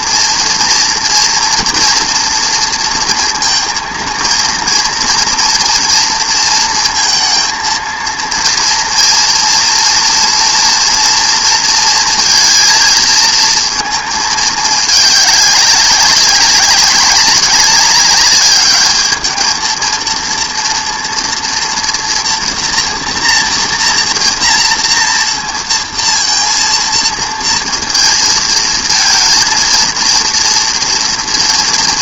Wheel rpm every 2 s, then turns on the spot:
230, 230, 230, 230, 230, 230, 230, 210, 200, 210, 230, 230, 230, 230, 230, 230.
none